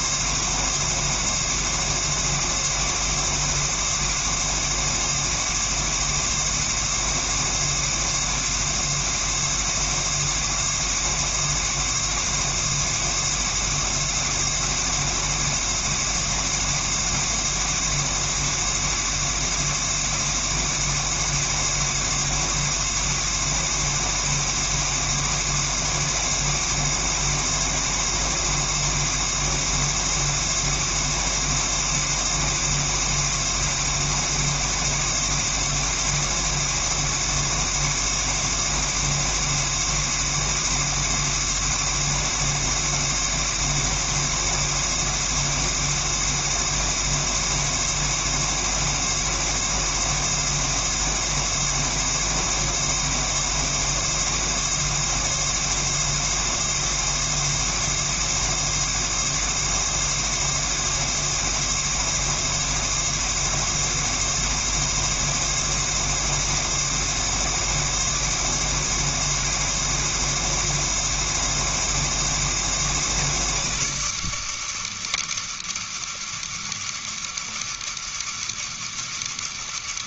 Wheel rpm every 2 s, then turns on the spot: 110, 120, 120, 120, 110, 110, 110, 120, 120, 120, 120, 120, 120, 120, 120, 120, 120, 120, 120, 120, 120, 120, 120, 120, 120, 120, 110, 110, 110, 110, 120, 110, 110, 120, 120, 120, 120, 150, 160, 160.
none